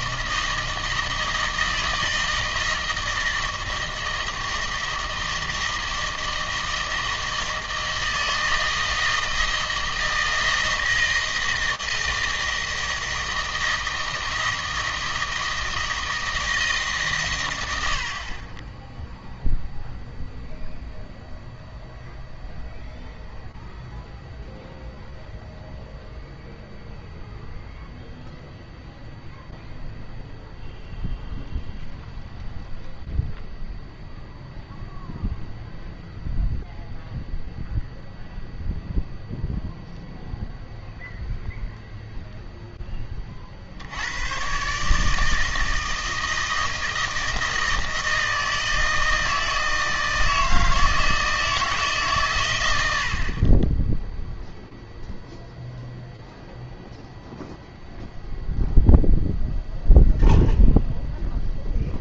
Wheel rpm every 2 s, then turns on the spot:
160, 160, 160, 160, 160, 160, 160, 160, 150, 10, 0, 0, 0, 0, 0, 0, 0, 0, 0, 0, 0, 10, 130, 160, 160, 160, 110, 0, 0, 0, 0.
none